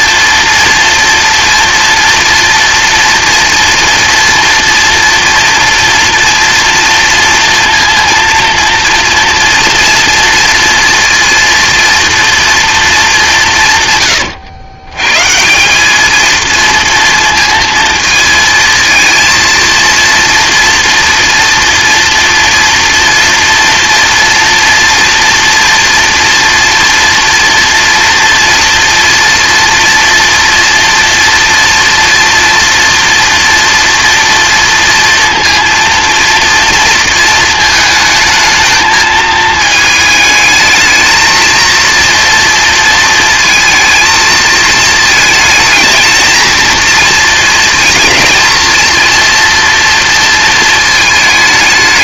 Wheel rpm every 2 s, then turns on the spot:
230, 230, 230, 230, 230, 230, 220, 120, 230, 220, 230, 230, 230, 230, 230, 230, 230, 230, 230, 220, 220, 230, 220, 230, 230, 220.
none